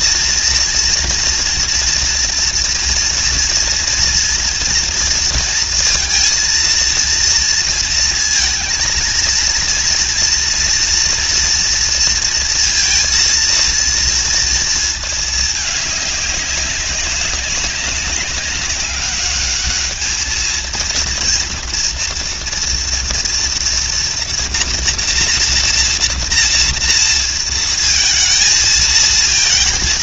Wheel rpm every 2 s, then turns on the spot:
230, 230, 230, 230, 230, 240, 230, 220, 200, 200, 230, 240, 240, 230, 230.
none